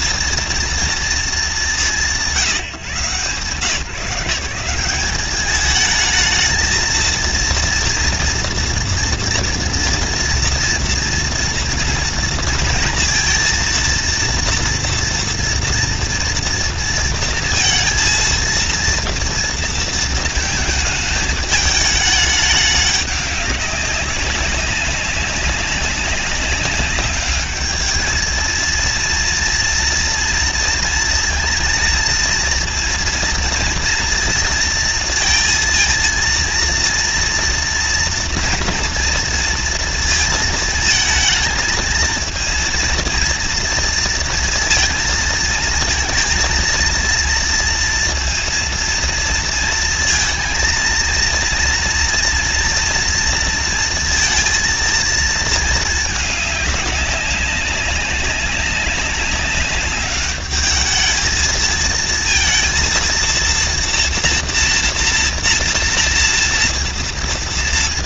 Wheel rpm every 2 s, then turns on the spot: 230, 170, 180, 230, 230, 230, 230, 230, 230, 230, 220, 200, 200, 200, 230, 230, 230, 230, 230, 230, 220, 230, 230, 230, 230, 230, 230, 230, 210, 190, 210, 230, 240, 230.
none